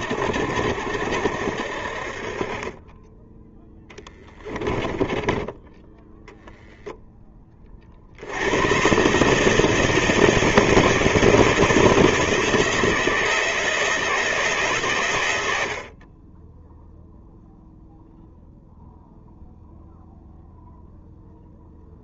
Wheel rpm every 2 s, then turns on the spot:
70, 10, 10, 0, 120, 160, 160, 140, 0, 0, 0.
4-6